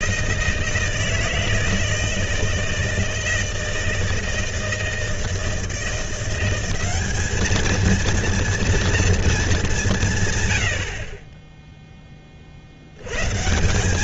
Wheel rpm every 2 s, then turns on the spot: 160, 160, 160, 190, 230, 90, 60.
none